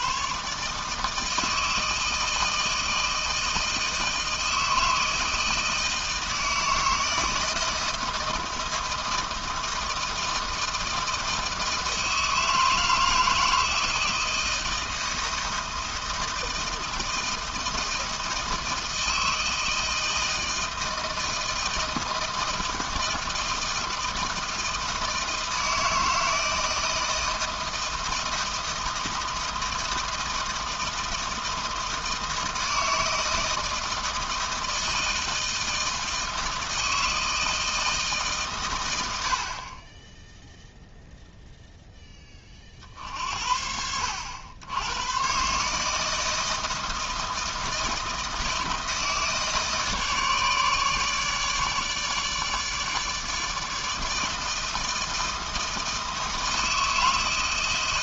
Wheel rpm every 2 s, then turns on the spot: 150, 160, 160, 160, 160, 160, 160, 160, 160, 160, 160, 160, 160, 160, 160, 160, 160, 160, 160, 120, 0, 40, 90, 160, 160, 150, 150, 160, 160.
none